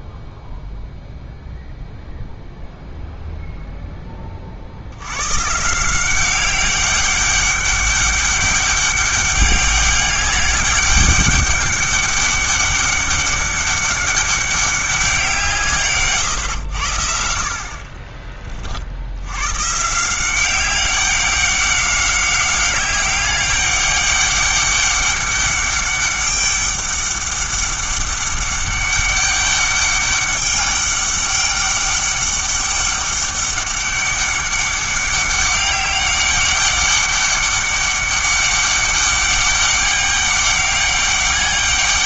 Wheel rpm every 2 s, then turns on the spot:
0, 0, 50, 190, 200, 200, 200, 200, 100, 40, 190, 200, 200, 200, 200, 200, 200, 200, 200, 200, 200.
none